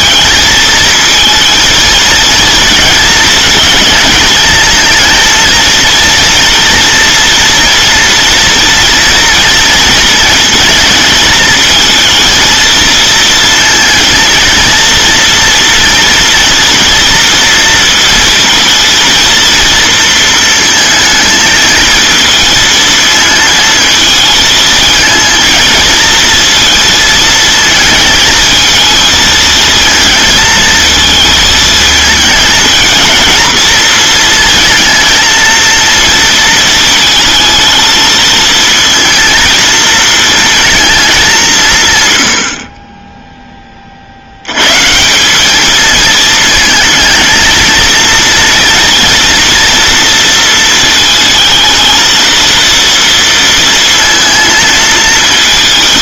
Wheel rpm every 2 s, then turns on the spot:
220, 230, 220, 230, 240, 230, 230, 230, 230, 230, 220, 220, 220, 230, 220, 230, 220, 230, 230, 230, 230, 50, 110, 230, 230, 230, 230, 230.
none